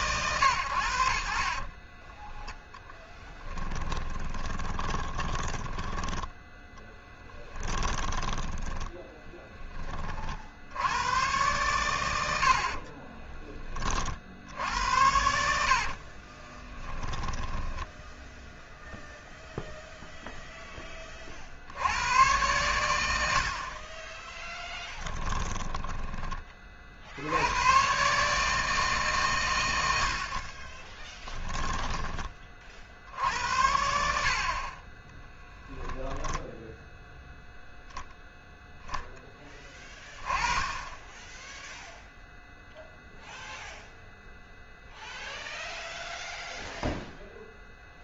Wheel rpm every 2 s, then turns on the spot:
90, 0, 20, 10, 20, 80, 50, 80, 20, 0, 20, 110, 10, 50, 150, 40, 50, 30, 0, 0, 20, 0, 0, 0.
4-6 8-10 16-18 24-26 30-32